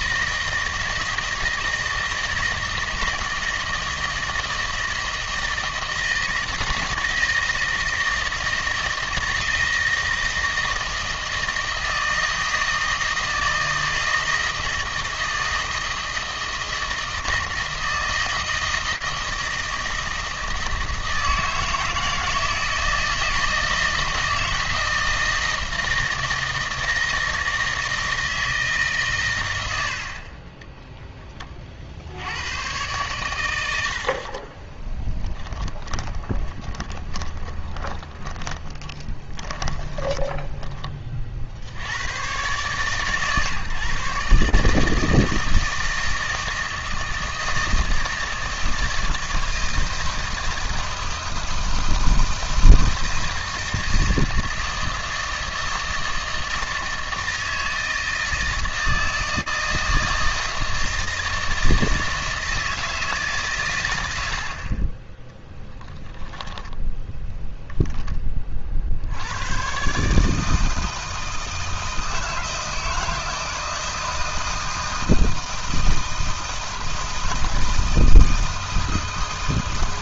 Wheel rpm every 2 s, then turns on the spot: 160, 160, 160, 160, 160, 160, 160, 160, 160, 160, 160, 160, 160, 160, 150, 20, 100, 30, 20, 20, 20, 120, 150, 160, 160, 160, 160, 160, 160, 160, 160, 160, 60, 0, 50, 160, 160, 160, 160, 160.
34-40